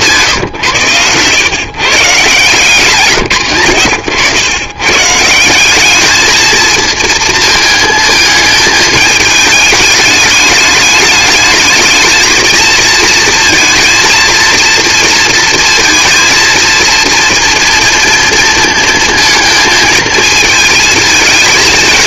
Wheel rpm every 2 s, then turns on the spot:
130, 150, 120, 220, 220, 210, 220, 230, 230, 230, 220.
none